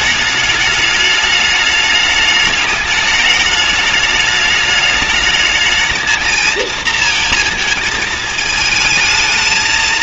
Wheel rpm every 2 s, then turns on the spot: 210, 210, 210, 220, 220.
none